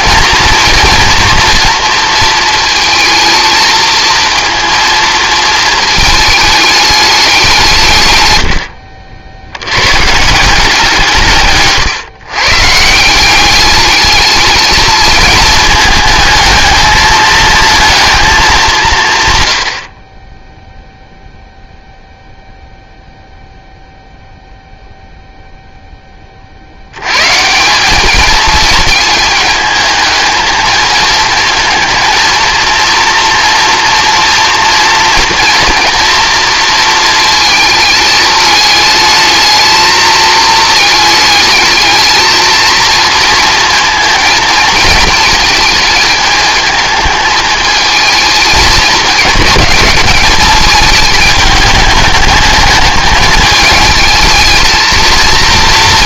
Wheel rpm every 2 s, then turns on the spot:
230, 220, 230, 210, 60, 170, 160, 220, 220, 180, 0, 0, 0, 80, 220, 220, 230, 230, 230, 220, 220, 230, 230, 220, 210, 220, 210, 220.
none